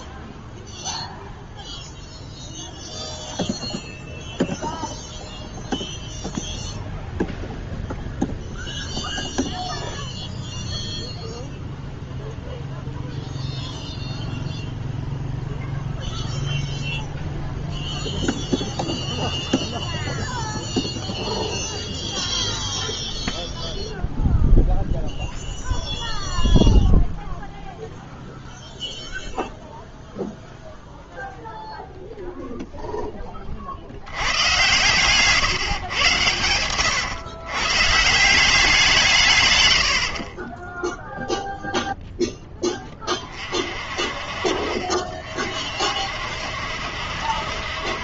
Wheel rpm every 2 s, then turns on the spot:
0, 0, 0, 0, 0, 0, 0, 0, 0, 0, 0, 0, 0, 0, 0, 0, 0, 110, 110, 180, 10, 10, 40, 60.
34-38